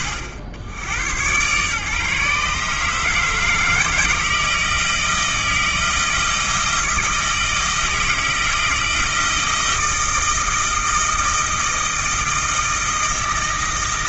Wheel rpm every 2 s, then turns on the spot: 90, 150, 160, 160, 160, 160, 160.
none